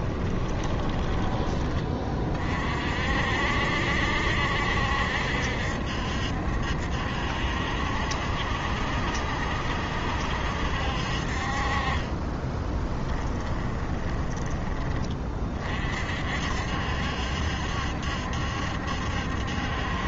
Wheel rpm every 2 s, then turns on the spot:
20, 50, 70, 70, 70, 60, 10, 20, 60, 70.
0-2 12-14